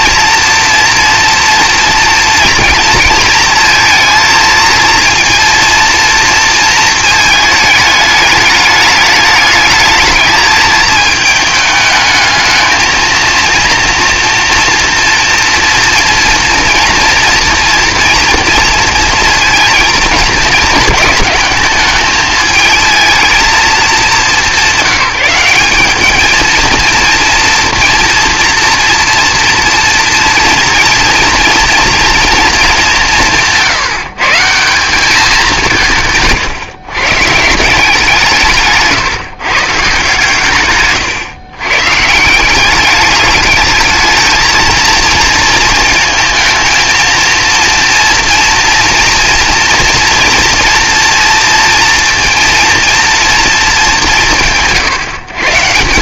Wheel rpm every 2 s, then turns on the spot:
240, 230, 230, 230, 210, 220, 220, 230, 230, 230, 220, 220, 190, 230, 240, 230, 210, 170, 130, 160, 130, 190, 220, 220, 230, 230, 230, 160.
40-42